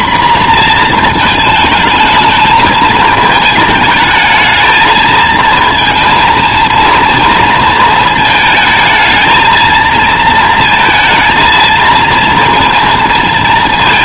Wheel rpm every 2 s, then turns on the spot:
240, 220, 220, 230, 220, 230, 230.
none